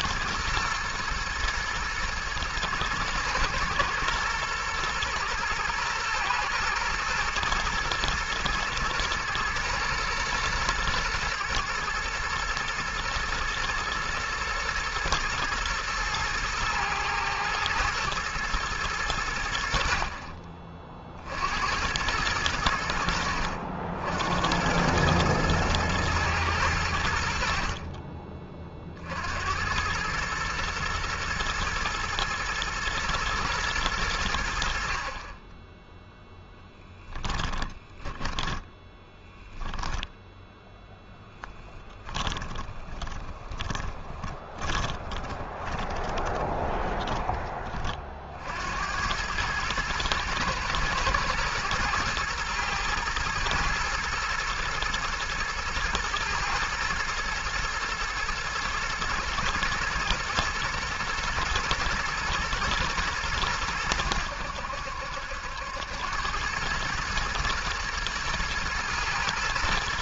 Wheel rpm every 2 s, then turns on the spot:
110, 110, 120, 110, 110, 120, 110, 110, 110, 110, 30, 90, 100, 100, 40, 110, 120, 70, 10, 10, 10, 20, 20, 20, 80, 110, 110, 110, 110, 110, 120, 110, 80, 110, 110.
36-48